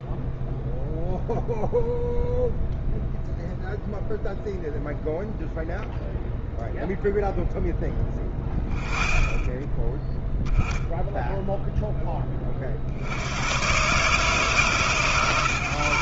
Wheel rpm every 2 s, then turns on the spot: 0, 0, 0, 0, 10, 0, 30, 150.
none